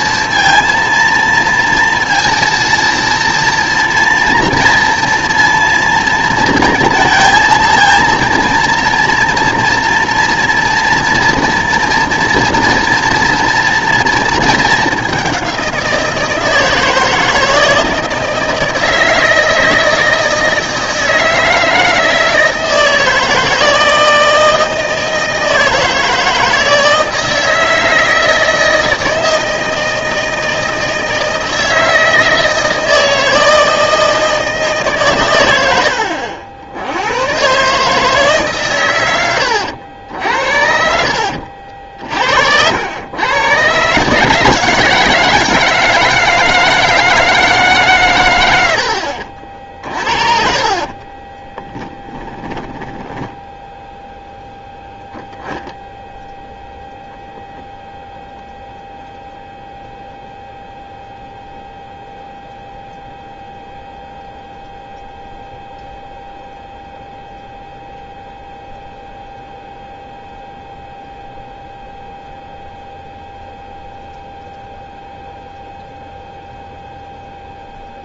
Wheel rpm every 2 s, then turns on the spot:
230, 230, 230, 230, 230, 230, 230, 220, 160, 160, 160, 160, 160, 160, 160, 160, 160, 160, 80, 140, 60, 80, 160, 160, 90, 40, 10, 0, 0, 0, 0, 0, 0, 0, 0, 0, 0, 0, 0.
40-42 52-54